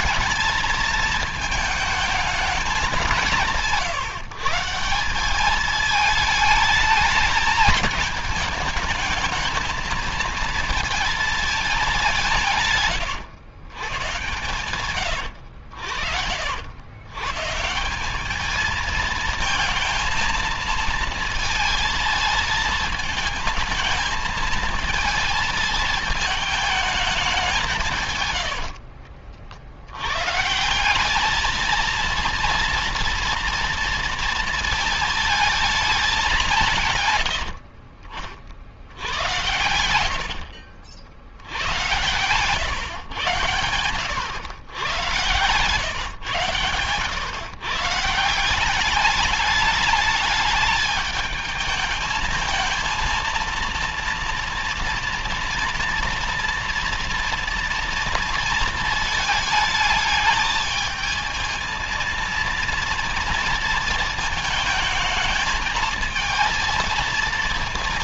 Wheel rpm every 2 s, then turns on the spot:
220, 210, 150, 220, 220, 220, 150, 130, 80, 210, 220, 220, 230, 220, 90, 150, 230, 230, 180, 60, 60, 110, 110, 120, 190, 210, 220, 230, 230, 230, 220, 230, 220, 230.
28-30 40-42